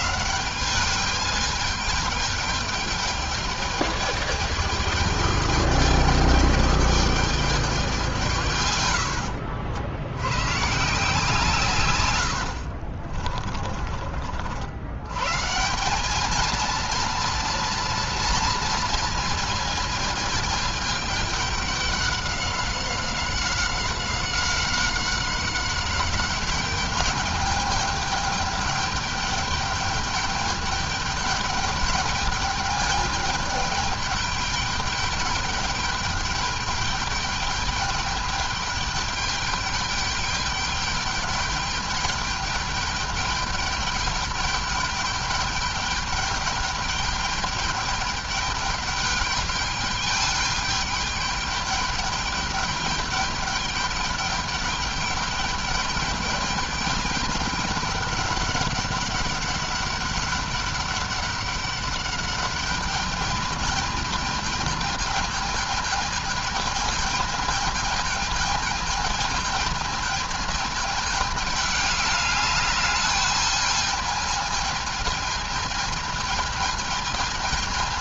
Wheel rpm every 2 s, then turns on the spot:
160, 210, 210, 210, 150, 110, 60, 60, 220, 230, 220, 200, 190, 200, 210, 210, 210, 210, 200, 210, 210, 210, 210, 210, 200, 210, 210, 210, 210, 200, 200, 210, 220, 210, 220, 220, 210, 220, 220.
12-14